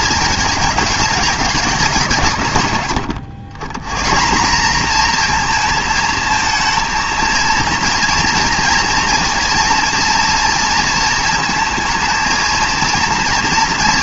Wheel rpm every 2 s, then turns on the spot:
220, 130, 210, 220, 230, 230, 220.
none